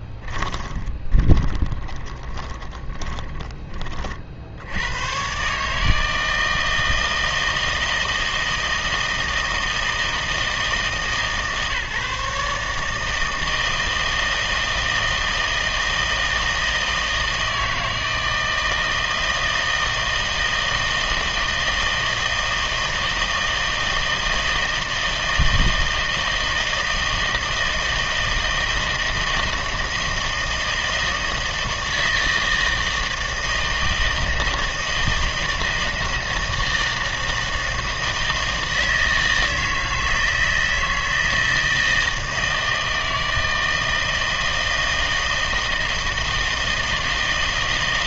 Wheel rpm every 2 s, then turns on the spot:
20, 20, 80, 160, 160, 150, 150, 160, 160, 160, 160, 160, 160, 160, 160, 160, 160, 160, 160, 160, 160, 160, 160, 160.
0-4